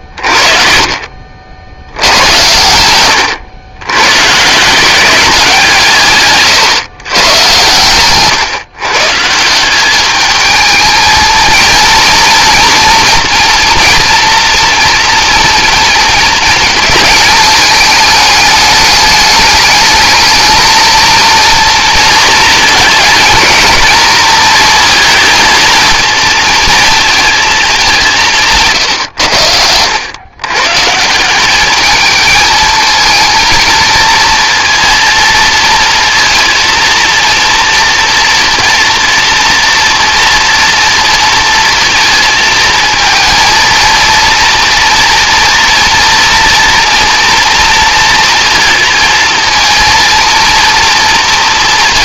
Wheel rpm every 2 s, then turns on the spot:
40, 100, 160, 140, 140, 210, 230, 230, 230, 210, 220, 230, 230, 230, 150, 130, 220, 230, 230, 230, 230, 220, 230, 230, 230, 230.
none